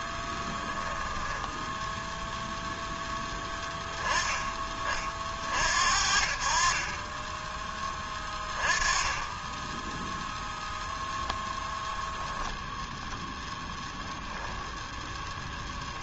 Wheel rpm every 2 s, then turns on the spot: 10, 10, 30, 30, 20, 0, 0, 0.
0-2